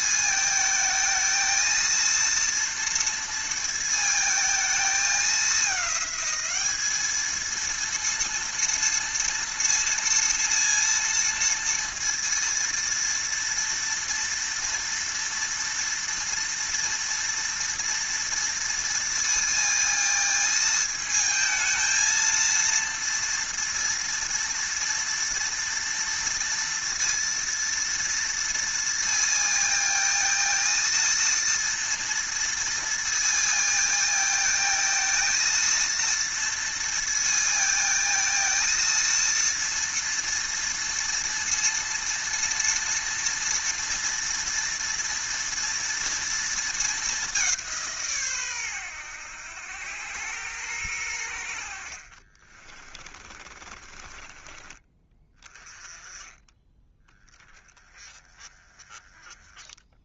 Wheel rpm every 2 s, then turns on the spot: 220, 230, 220, 220, 230, 230, 230, 230, 230, 230, 220, 230, 230, 230, 230, 230, 230, 230, 230, 230, 230, 230, 230, 220, 100, 100, 30, 20, 10, 20.
52-54